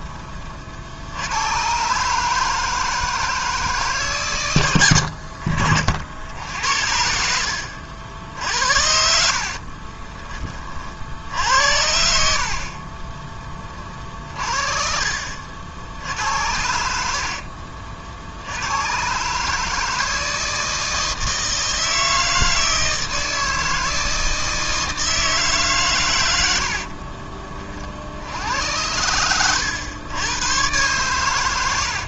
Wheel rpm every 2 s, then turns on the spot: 70, 160, 90, 70, 60, 60, 30, 40, 80, 110, 160, 160, 160, 50, 90, 110.
8-10 16-18 26-28